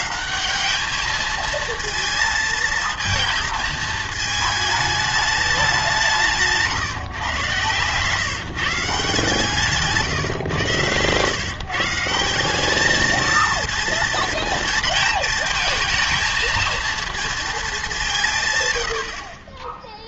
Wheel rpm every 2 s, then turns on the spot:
190, 230, 220, 150, 150, 120, 200, 230, 220, 120.
none